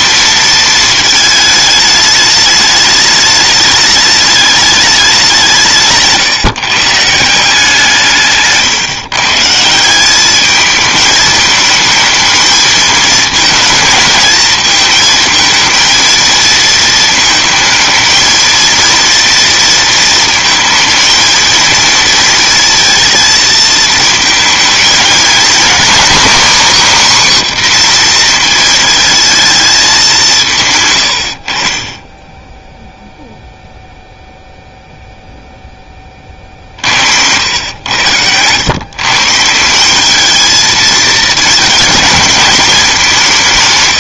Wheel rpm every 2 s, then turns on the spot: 230, 210, 210, 140, 140, 210, 220, 220, 220, 230, 230, 230, 220, 280, 230, 150, 10, 0, 40, 110, 220, 210.
none